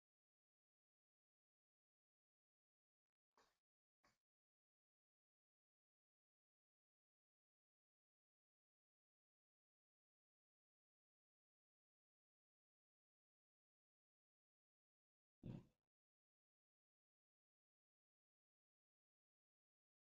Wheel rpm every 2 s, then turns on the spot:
0, 0, 0, 0, 0, 0, 0, 0, 0, 0.
none